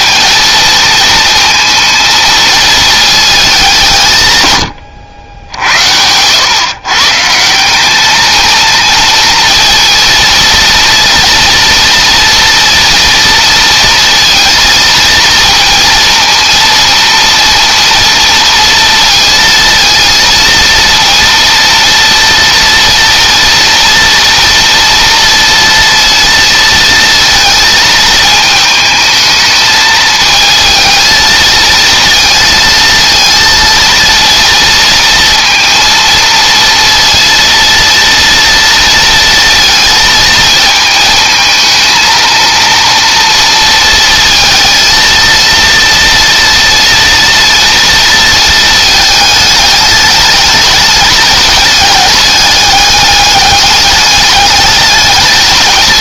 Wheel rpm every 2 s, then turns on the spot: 230, 220, 90, 150, 230, 230, 230, 230, 230, 230, 230, 230, 230, 230, 220, 220, 230, 230, 230, 230, 220, 230, 230, 230, 220, 210, 200, 210.
none